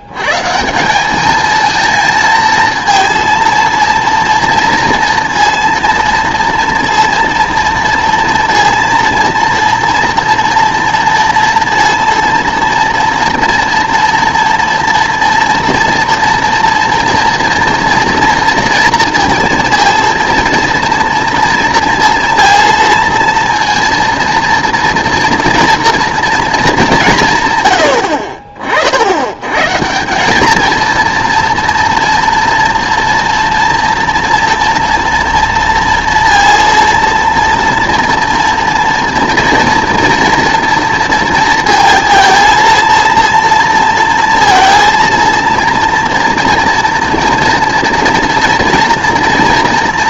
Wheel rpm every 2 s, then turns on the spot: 170, 230, 230, 230, 230, 230, 230, 230, 230, 230, 230, 230, 230, 200, 60, 230, 240, 230, 230, 230, 230, 230, 230, 230, 230.
none